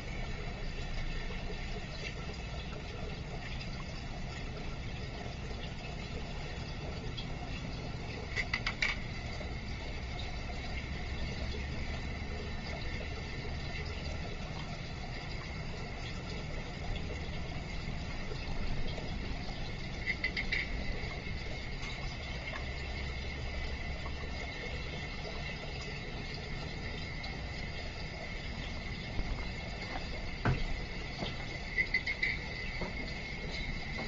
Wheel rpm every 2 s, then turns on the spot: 0, 0, 0, 0, 0, 0, 0, 0, 0, 0, 0, 0, 0, 0, 0, 0, 0.
none